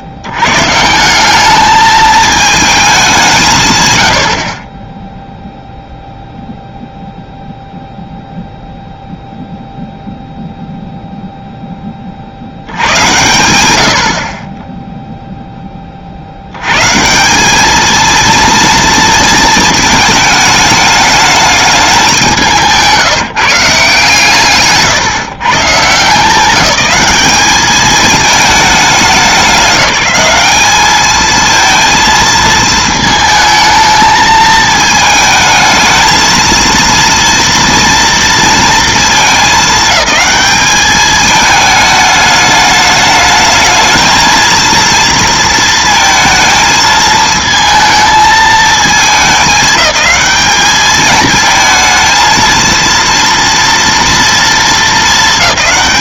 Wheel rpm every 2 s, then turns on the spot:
90, 220, 50, 0, 0, 0, 60, 30, 90, 230, 210, 180, 130, 200, 210, 210, 230, 220, 230, 230, 210, 210, 230, 220, 220, 210, 230, 230.
none